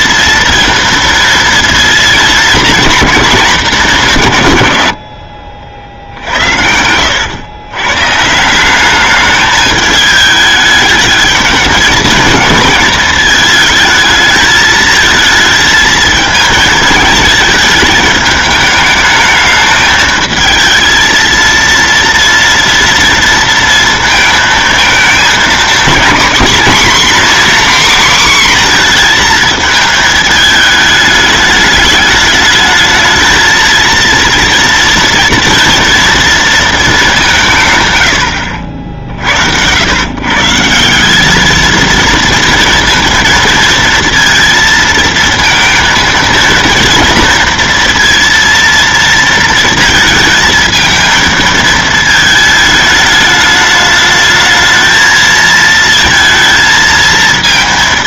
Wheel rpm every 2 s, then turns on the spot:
230, 220, 140, 80, 170, 210, 220, 220, 220, 210, 220, 230, 230, 260, 250, 210, 210, 230, 230, 70, 160, 230, 230, 230, 230, 220, 220, 220, 230.
6-8